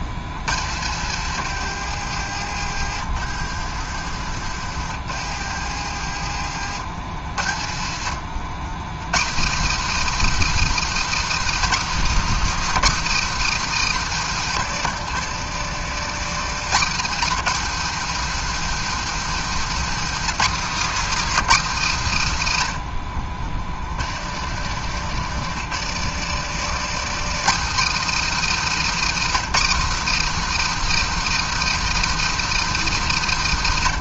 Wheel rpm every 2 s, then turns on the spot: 120, 100, 100, 100, 140, 320, 320, 180, 230, 280, 300, 120, 130, 180, 300, 330, 300.
2-6 14-16 24-26